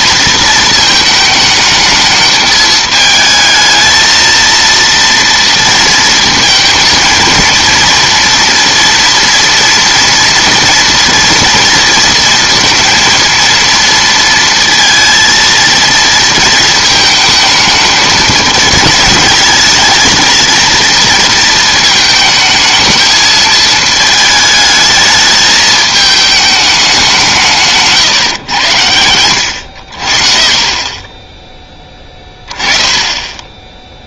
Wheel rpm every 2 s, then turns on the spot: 230, 210, 230, 230, 230, 230, 230, 230, 230, 220, 230, 220, 220, 210, 120, 40, 10.
none